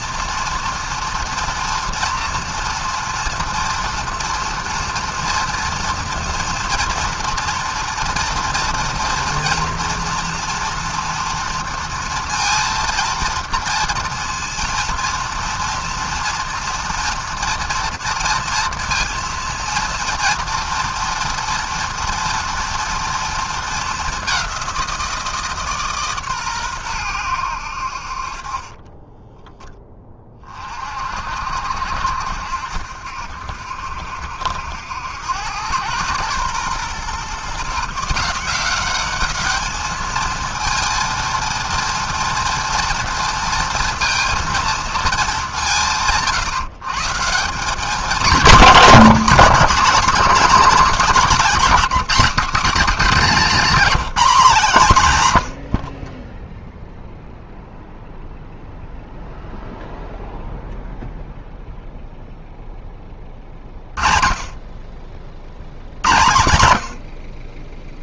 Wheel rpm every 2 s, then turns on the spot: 230, 230, 230, 230, 230, 240, 230, 230, 230, 230, 230, 230, 180, 130, 30, 40, 70, 70, 120, 180, 230, 230, 230, 140, 200, 240, 240, 190, 0, 0, 0, 0, 30, 90.
none